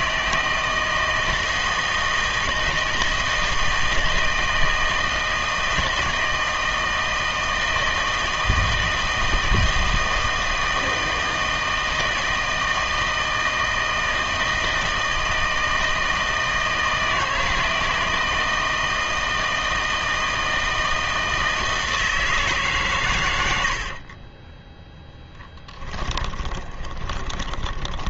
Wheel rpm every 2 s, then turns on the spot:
160, 160, 160, 160, 160, 160, 160, 160, 160, 160, 160, 150, 10, 20.
24-28